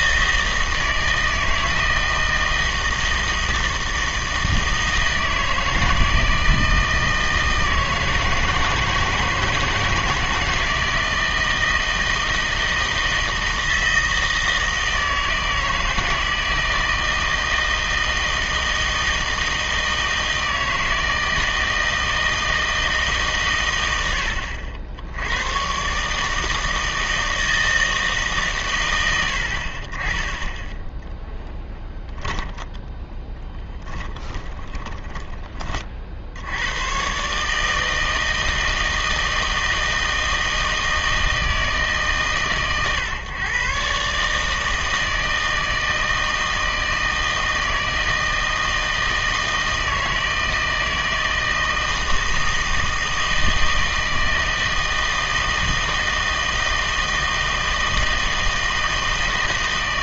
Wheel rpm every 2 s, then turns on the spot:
160, 160, 160, 160, 160, 160, 160, 160, 160, 160, 160, 160, 70, 160, 100, 0, 10, 20, 100, 160, 160, 130, 160, 160, 160, 160, 160, 160, 160, 160.
32-36